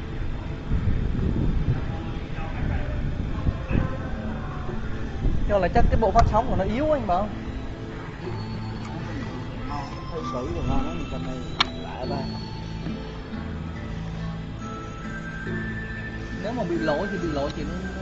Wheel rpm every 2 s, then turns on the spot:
0, 0, 0, 0, 0, 0, 0, 0, 0.
none